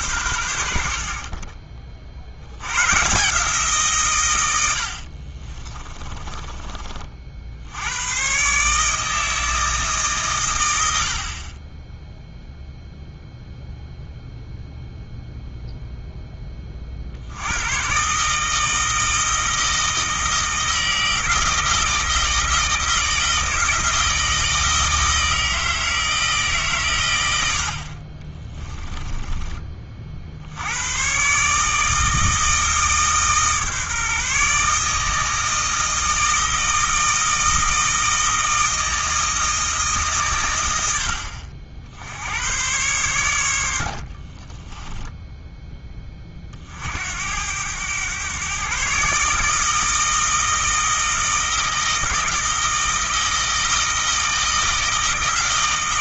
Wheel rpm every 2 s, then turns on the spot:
80, 100, 80, 30, 150, 100, 0, 0, 30, 160, 160, 160, 160, 140, 20, 100, 160, 150, 160, 160, 100, 110, 20, 50, 130, 160, 160, 160.
4-6 28-30 44-46